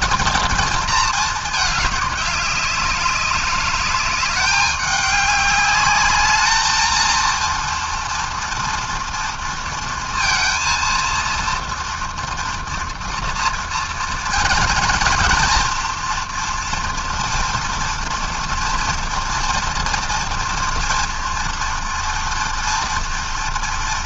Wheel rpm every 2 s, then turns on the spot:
220, 200, 200, 230, 230, 230, 230, 230, 230, 230, 230, 230.
none